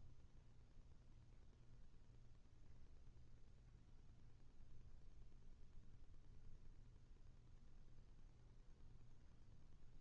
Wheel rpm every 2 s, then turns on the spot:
0, 0, 0, 0, 0.
none